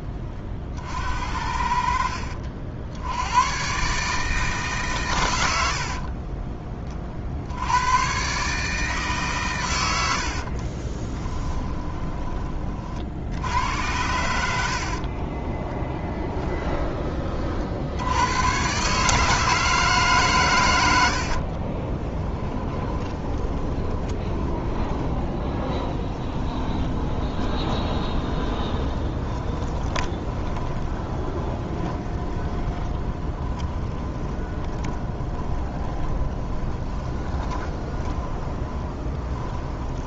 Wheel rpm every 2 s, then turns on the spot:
40, 70, 150, 40, 150, 40, 50, 60, 10, 120, 110, 10, 20, 20, 20, 20, 20, 20, 20, 20.
10-12 14-16 22-40